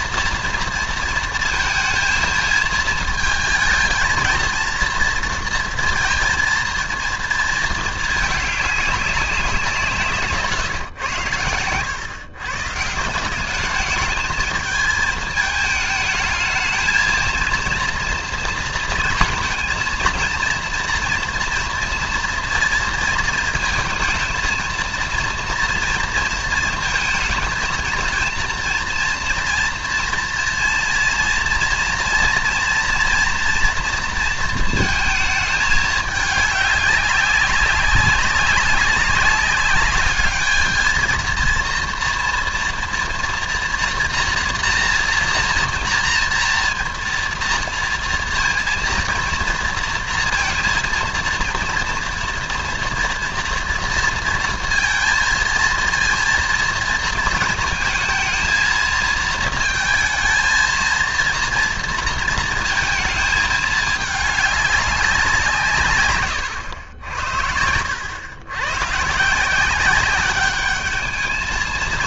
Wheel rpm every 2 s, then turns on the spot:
230, 230, 230, 230, 210, 120, 150, 220, 220, 230, 230, 230, 230, 230, 230, 230, 230, 230, 200, 190, 220, 240, 240, 230, 230, 230, 230, 230, 230, 220, 220, 220, 200, 100, 120, 210.
none